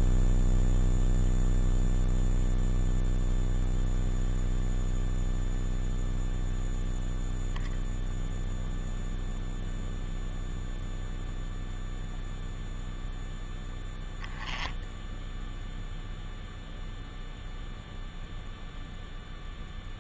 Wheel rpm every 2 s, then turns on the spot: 0, 0, 0, 0, 0, 0, 0, 0, 0, 0.
none